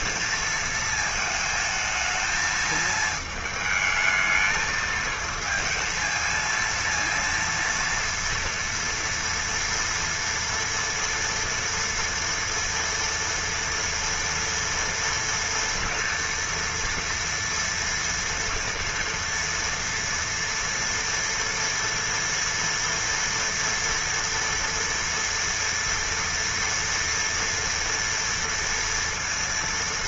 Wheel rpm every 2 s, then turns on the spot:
230, 220, 220, 230, 240, 230, 230, 230, 230, 230, 230, 230, 230, 230, 230.
none